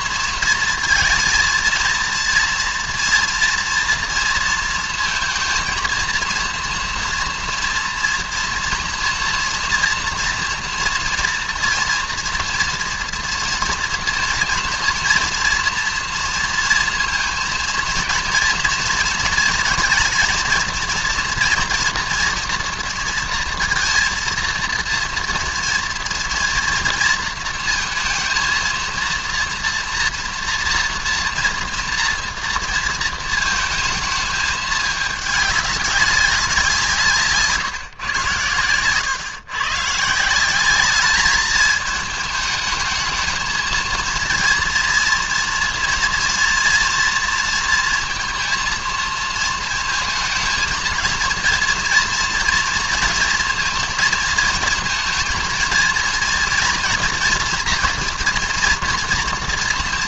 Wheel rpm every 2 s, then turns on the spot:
230, 230, 230, 230, 240, 230, 230, 230, 230, 240, 230, 230, 230, 230, 230, 230, 230, 210, 170, 110, 190, 210, 230, 230, 230, 220, 230, 230, 240, 230.
none